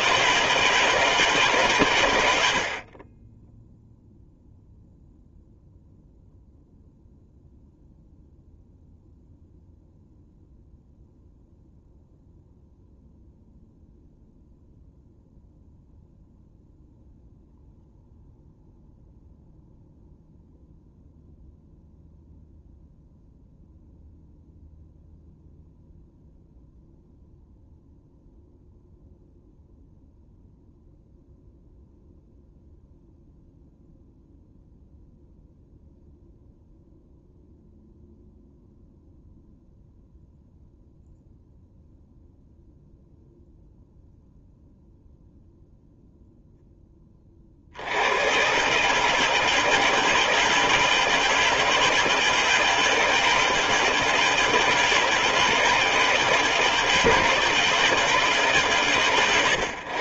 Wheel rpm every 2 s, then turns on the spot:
160, 50, 0, 0, 0, 0, 0, 0, 0, 0, 0, 0, 0, 0, 0, 0, 0, 0, 0, 0, 0, 0, 0, 10, 140, 160, 160, 160, 160, 120.
none